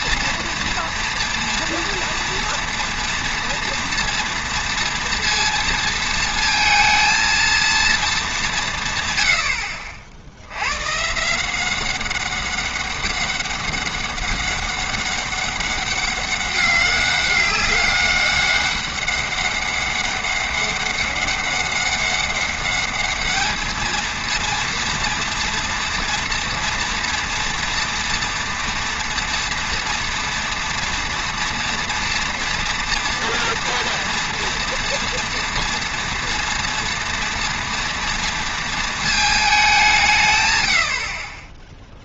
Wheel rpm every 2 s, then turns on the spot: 230, 240, 230, 230, 170, 100, 200, 200, 200, 200, 200, 200, 230, 230, 230, 240, 230, 230, 240, 230, 110.
none